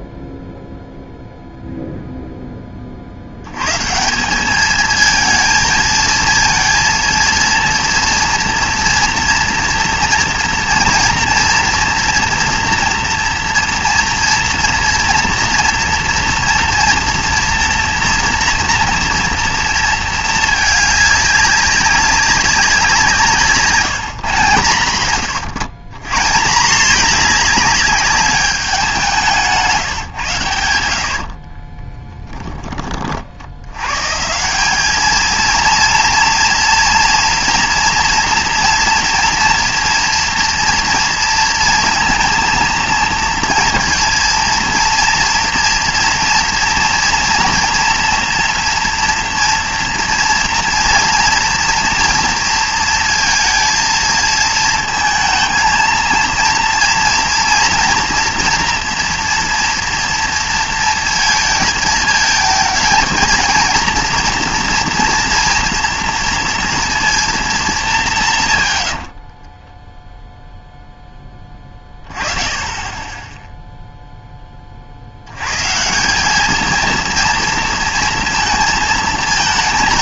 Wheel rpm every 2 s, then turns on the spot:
0, 30, 210, 230, 230, 230, 230, 230, 230, 230, 210, 180, 120, 190, 200, 80, 40, 200, 240, 240, 230, 230, 230, 230, 230, 230, 230, 220, 230, 240, 230, 220, 230, 230, 90, 0, 20, 40, 220, 230.
68-70